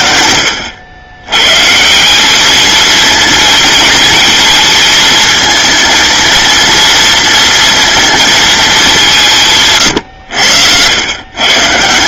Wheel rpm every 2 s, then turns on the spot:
110, 230, 220, 230, 160, 120.
none